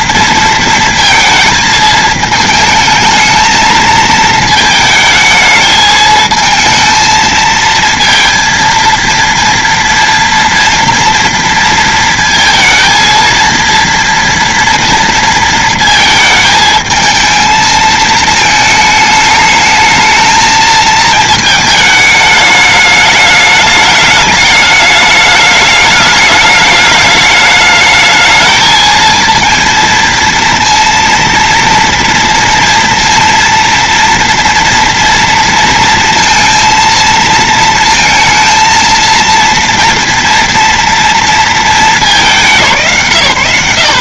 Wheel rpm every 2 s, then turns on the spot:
230, 220, 220, 220, 230, 230, 230, 230, 230, 220, 220, 210, 210, 210, 210, 230, 230, 230, 230, 230, 230, 210.
none